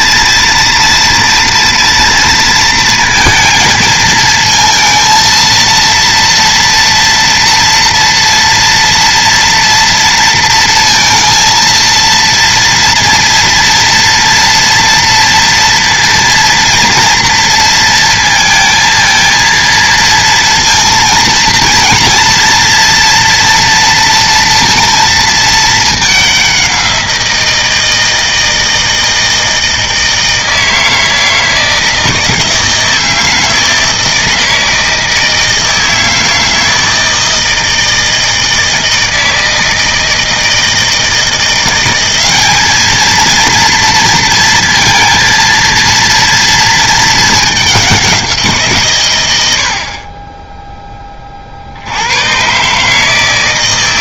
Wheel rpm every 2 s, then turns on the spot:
240, 230, 230, 240, 240, 230, 230, 230, 230, 220, 230, 230, 230, 190, 160, 160, 160, 160, 160, 160, 160, 210, 230, 230, 160, 20, 140.
none